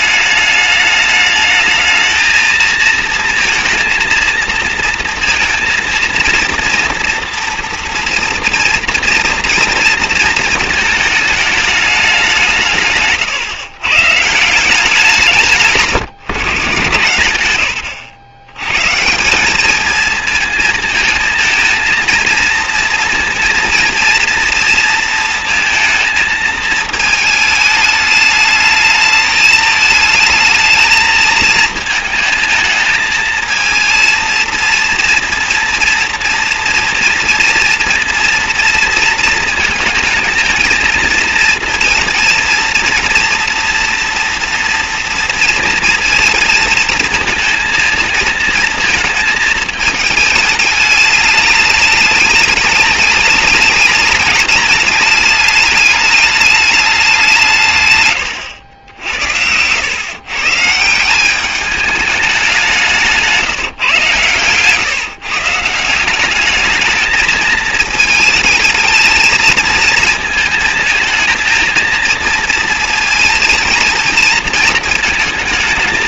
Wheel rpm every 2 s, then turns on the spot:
210, 230, 230, 240, 230, 220, 150, 190, 150, 140, 220, 230, 230, 220, 210, 220, 220, 230, 230, 230, 230, 230, 230, 220, 230, 210, 210, 210, 190, 80, 160, 180, 140, 220, 220, 230, 230, 220.
none